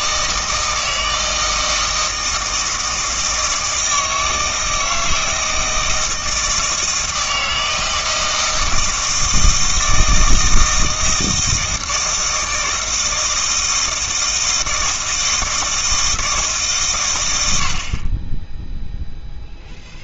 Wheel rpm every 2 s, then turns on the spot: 160, 160, 160, 160, 160, 160, 160, 160, 140, 0.
none